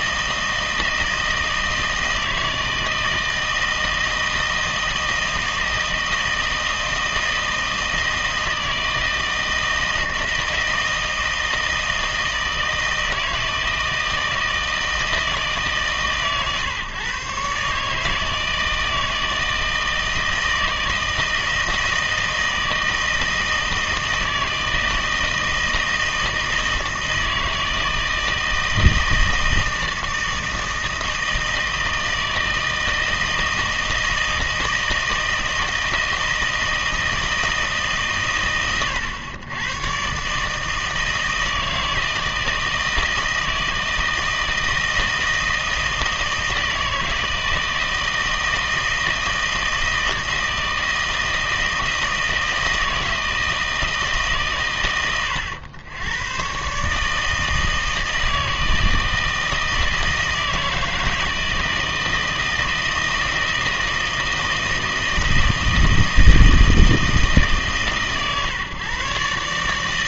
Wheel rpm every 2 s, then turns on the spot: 160, 160, 160, 160, 160, 160, 160, 160, 140, 160, 160, 160, 160, 160, 160, 160, 160, 160, 160, 110, 160, 160, 160, 160, 160, 160, 160, 120, 130, 160, 160, 160, 160, 160, 140.
none